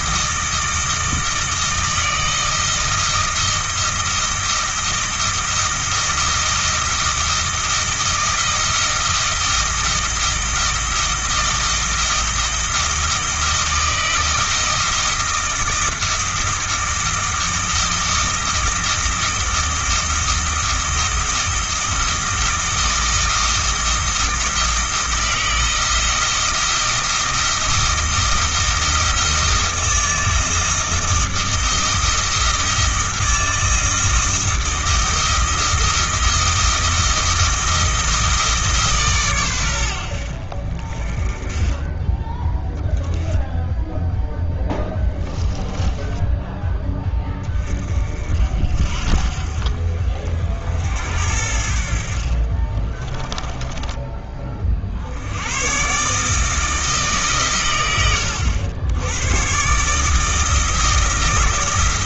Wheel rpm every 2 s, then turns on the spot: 160, 160, 160, 160, 170, 160, 160, 160, 170, 160, 160, 170, 160, 160, 160, 160, 160, 170, 160, 150, 50, 10, 10, 10, 50, 70, 30, 40, 160, 90, 160.
44-46 52-54